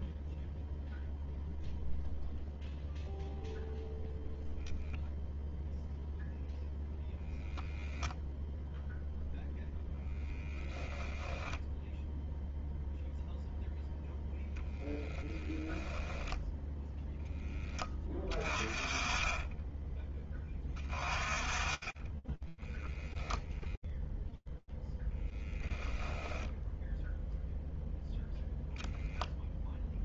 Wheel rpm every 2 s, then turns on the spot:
10, 0, 10, 0, 0, 0, 0, 10, 20, 20, 10, 0, 0, 0, 20.
20-22